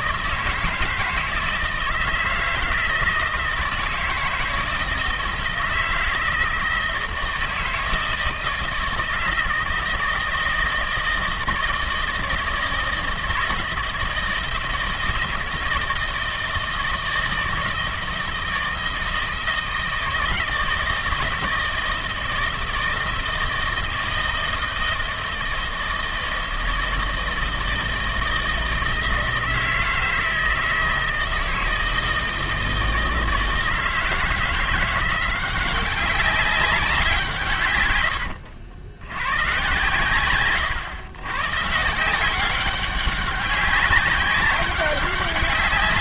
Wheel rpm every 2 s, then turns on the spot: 160, 160, 160, 160, 160, 160, 160, 160, 160, 160, 160, 160, 160, 160, 160, 160, 160, 160, 190, 80, 120, 190, 200.
none